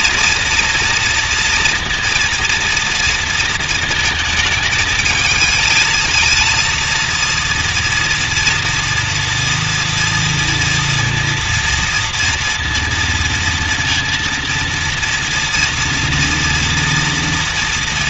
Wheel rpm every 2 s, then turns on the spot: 240, 230, 220, 230, 230, 230, 240, 230, 240.
none